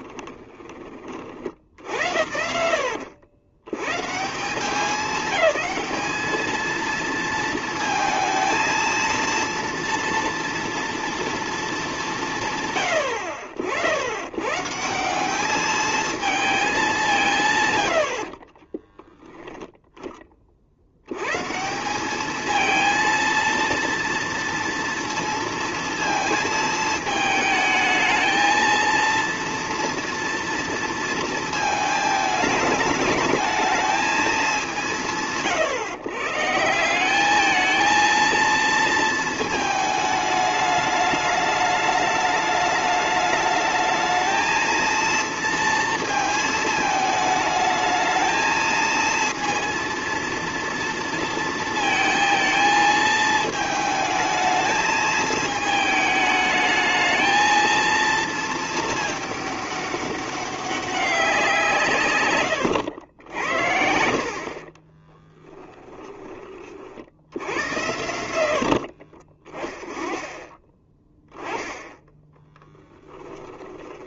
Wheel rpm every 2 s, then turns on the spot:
20, 80, 190, 220, 220, 230, 130, 140, 210, 20, 60, 220, 230, 220, 230, 230, 220, 200, 170, 230, 210, 210, 230, 220, 220, 230, 220, 220, 210, 220, 200, 110, 30, 30, 60, 10, 10.
18-20 64-66 68-70 72-74